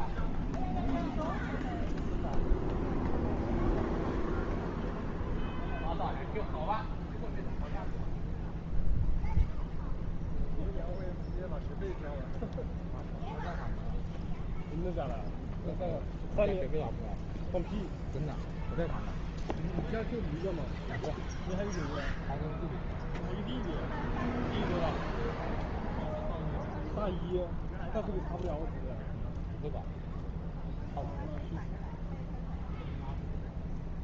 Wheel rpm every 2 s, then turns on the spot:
0, 0, 0, 0, 0, 0, 0, 0, 0, 0, 0, 0, 0, 0, 0, 0, 0.
none